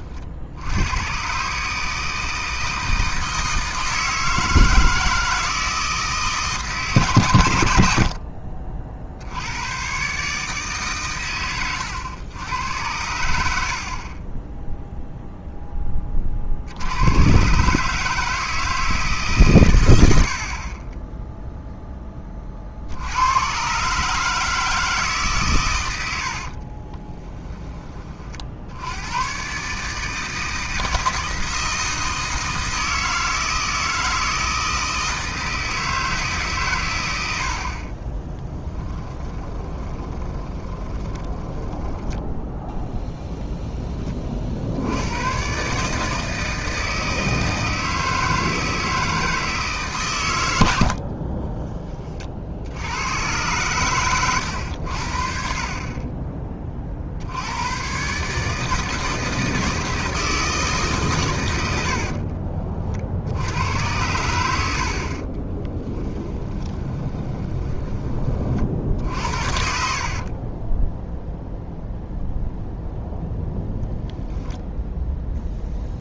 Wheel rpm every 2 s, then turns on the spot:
130, 160, 160, 120, 80, 120, 80, 0, 110, 140, 0, 90, 140, 20, 60, 160, 160, 160, 140, 20, 30, 10, 60, 160, 160, 90, 60, 100, 30, 150, 160, 50, 80, 20, 40, 30, 0, 0.
26-28 38-42 62-64 66-68 70-72